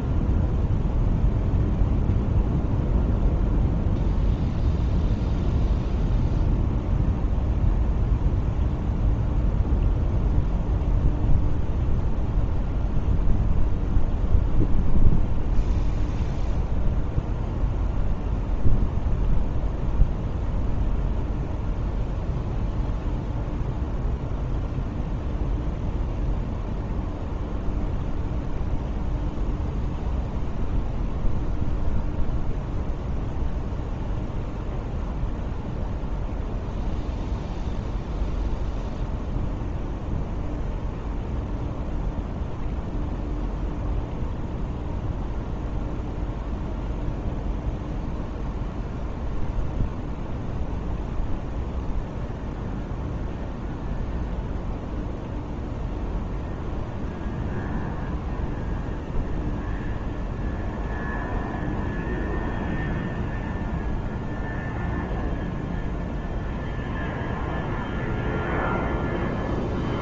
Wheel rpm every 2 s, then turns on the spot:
0, 0, 0, 0, 0, 0, 0, 0, 0, 0, 0, 0, 0, 0, 0, 0, 0, 0, 0, 0, 0, 0, 0, 0, 0, 0, 0, 0, 0, 0, 0, 0, 0, 0, 0.
none